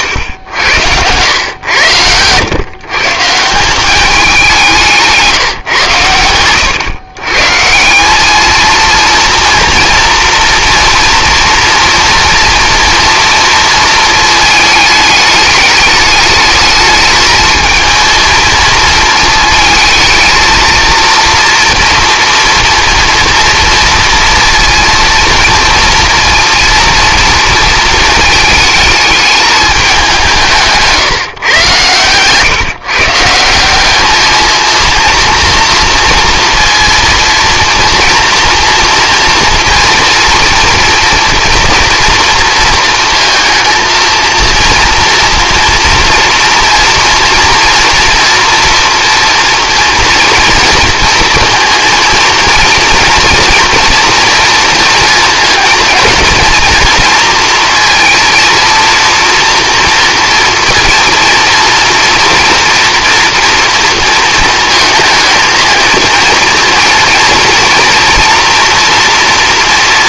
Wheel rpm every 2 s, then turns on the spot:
100, 130, 180, 110, 220, 230, 230, 210, 220, 220, 230, 230, 230, 230, 220, 160, 140, 230, 230, 230, 230, 230, 230, 230, 230, 230, 230, 230, 230, 230, 230, 240, 220, 230, 240.
none